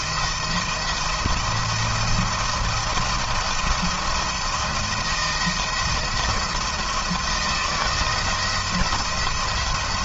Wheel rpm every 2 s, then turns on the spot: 170, 170, 170, 170, 170.
none